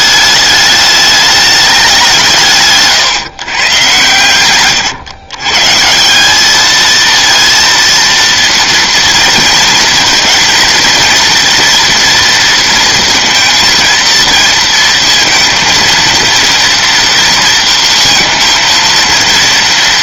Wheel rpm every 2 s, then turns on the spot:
210, 150, 120, 220, 230, 230, 230, 230, 230, 230.
none